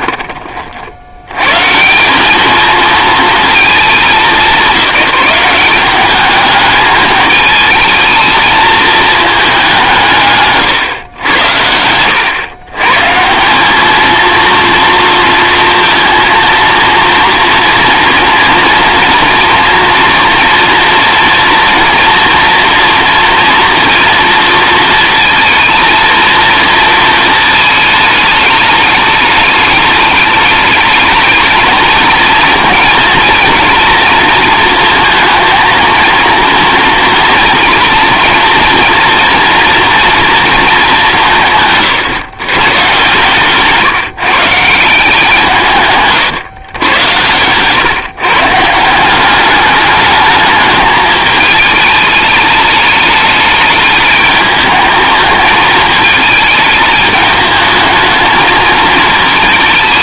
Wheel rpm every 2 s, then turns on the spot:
60, 220, 180, 210, 220, 130, 120, 230, 230, 230, 230, 240, 230, 230, 210, 220, 240, 230, 230, 230, 210, 140, 160, 110, 160, 210, 210, 210, 210, 220.
none